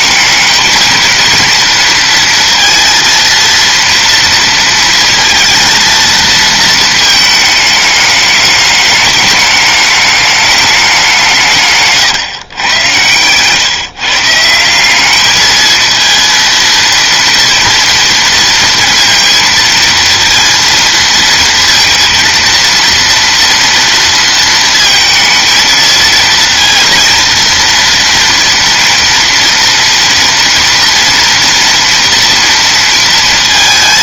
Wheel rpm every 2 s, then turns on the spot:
220, 230, 230, 230, 210, 210, 120, 180, 230, 230, 230, 230, 230, 230, 240, 230, 230.
none